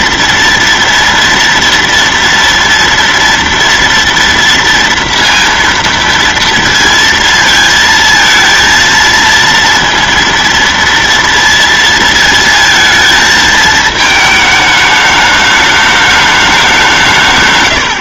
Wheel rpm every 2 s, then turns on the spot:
230, 230, 230, 230, 230, 230, 220, 220, 200.
none